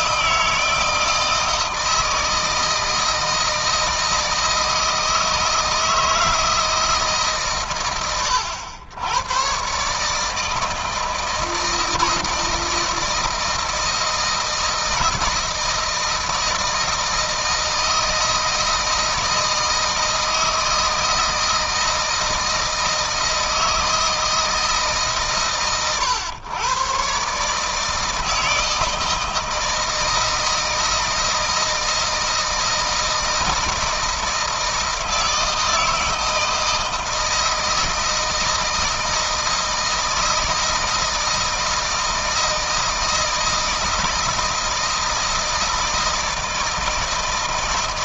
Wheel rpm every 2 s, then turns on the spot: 160, 160, 160, 160, 90, 160, 160, 160, 160, 160, 160, 160, 150, 120, 160, 160, 160, 160, 160, 160, 160, 160, 160, 160.
none